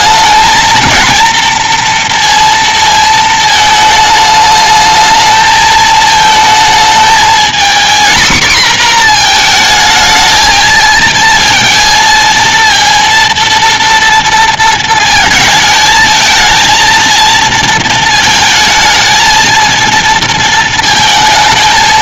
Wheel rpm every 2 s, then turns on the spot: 220, 230, 210, 220, 240, 220, 230, 230, 230, 230, 230.
none